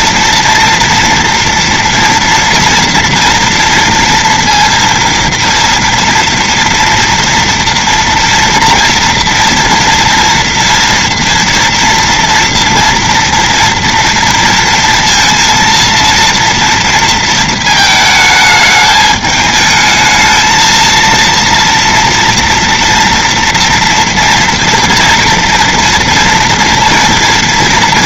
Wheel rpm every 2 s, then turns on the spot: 240, 230, 230, 230, 230, 230, 230, 230, 230, 220, 220, 230, 230, 230.
none